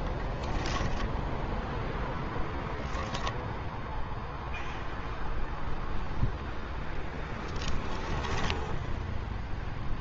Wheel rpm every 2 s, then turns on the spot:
10, 0, 0, 0, 0.
0-2